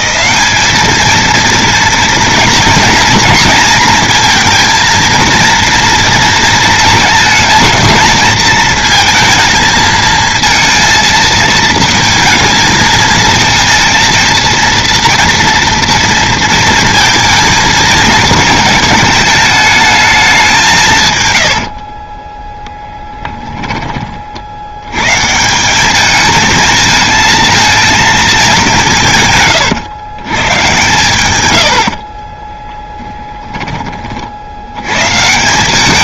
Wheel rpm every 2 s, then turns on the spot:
210, 230, 230, 230, 230, 230, 220, 230, 230, 220, 180, 10, 70, 220, 200, 120, 20, 80.
22-24 32-34